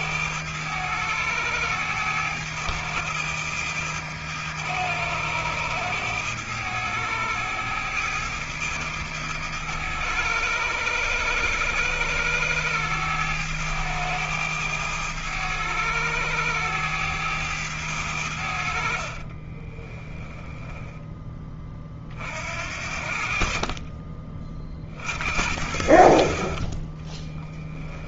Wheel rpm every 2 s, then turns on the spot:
100, 110, 100, 100, 110, 100, 110, 100, 100, 40, 20, 60, 70, 30.
18-20 26-28